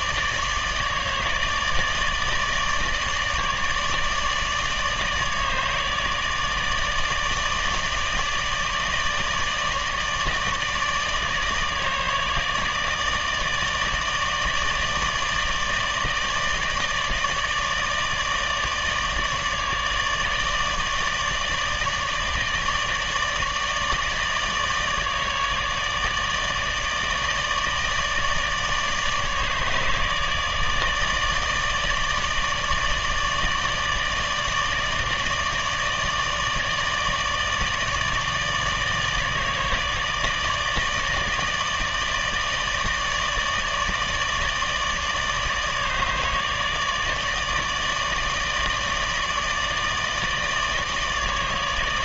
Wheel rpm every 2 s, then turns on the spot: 150, 150, 150, 160, 160, 160, 150, 150, 150, 150, 160, 160, 160, 150, 150, 150, 150, 160, 150, 150, 160, 150, 160, 150, 150, 160.
none